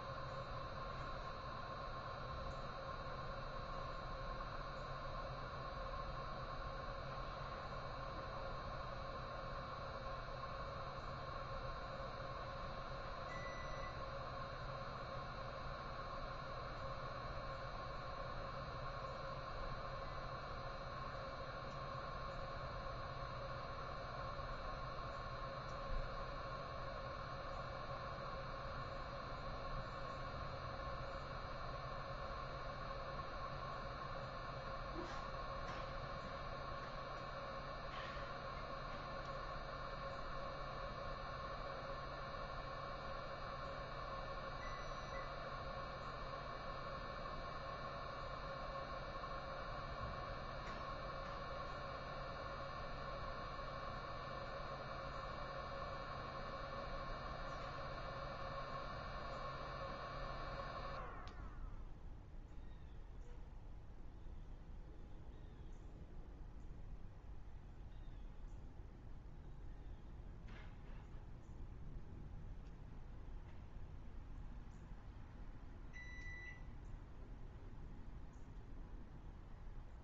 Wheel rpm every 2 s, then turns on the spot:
0, 0, 0, 0, 0, 0, 0, 0, 0, 0, 0, 0, 0, 0, 0, 0, 0, 0, 0, 0, 0, 0, 0, 0, 0, 0, 0, 0, 0, 0, 0, 0, 0, 0, 0, 0, 0, 0, 0, 0.
none